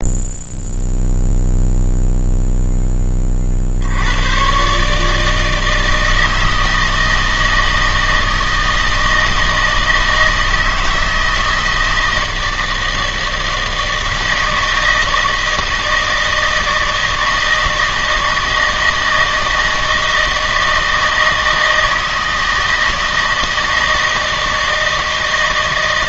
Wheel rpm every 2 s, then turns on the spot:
0, 0, 140, 160, 160, 160, 160, 160, 160, 160, 160, 160, 160.
none